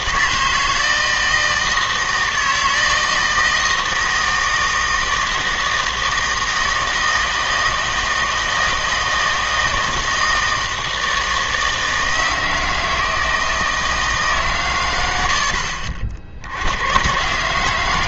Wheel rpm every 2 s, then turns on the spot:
160, 160, 160, 160, 160, 160, 160, 120, 80.
none